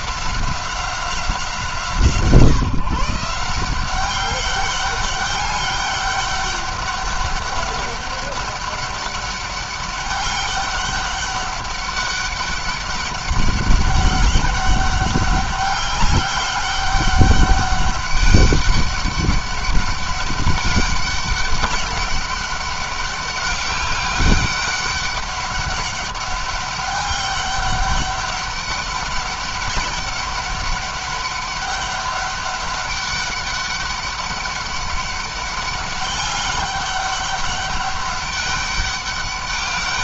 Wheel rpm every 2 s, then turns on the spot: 190, 150, 200, 200, 200, 200, 200, 200, 200, 200, 200, 200, 200, 200, 200, 200, 200, 200, 200, 200.
none